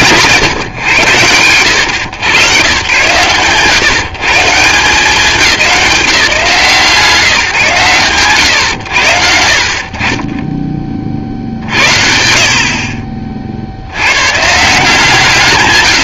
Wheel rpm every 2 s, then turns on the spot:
120, 90, 170, 160, 90, 0, 50, 160.
none